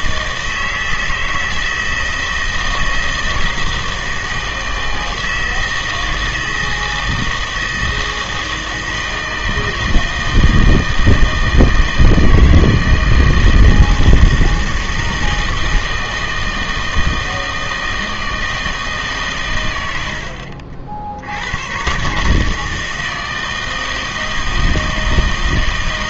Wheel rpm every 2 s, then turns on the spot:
160, 160, 160, 160, 160, 160, 160, 160, 160, 160, 50, 160, 160.
none